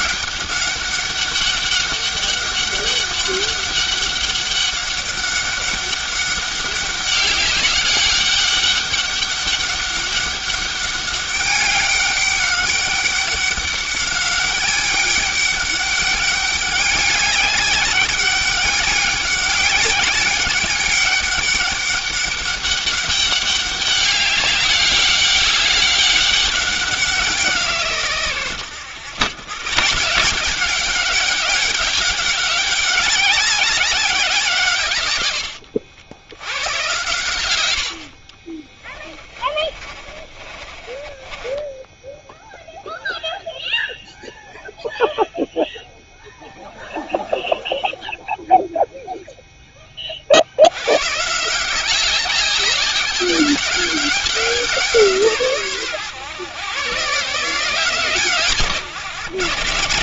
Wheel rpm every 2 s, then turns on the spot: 200, 200, 200, 200, 200, 200, 200, 200, 200, 200, 200, 200, 200, 190, 110, 200, 190, 120, 110, 20, 30, 0, 0, 20, 0, 120, 200, 170, 140, 130.
38-42